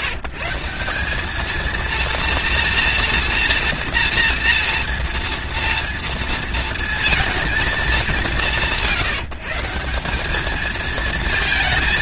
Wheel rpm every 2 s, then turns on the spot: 160, 230, 230, 230, 130, 220.
none